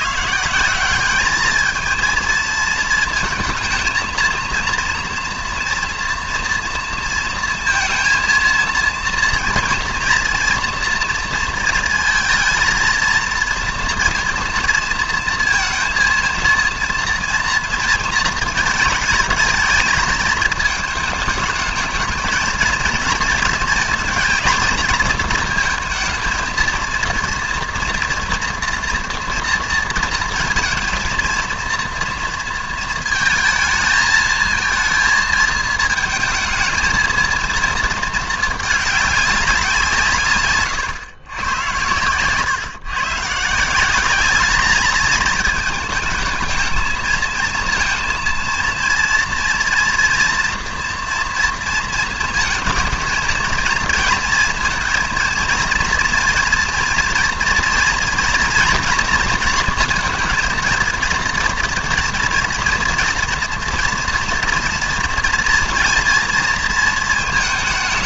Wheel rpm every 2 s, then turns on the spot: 190, 230, 230, 230, 230, 240, 230, 230, 230, 220, 220, 220, 230, 230, 230, 230, 230, 220, 220, 210, 130, 130, 210, 220, 230, 230, 220, 220, 230, 240, 230, 230, 240, 230.
none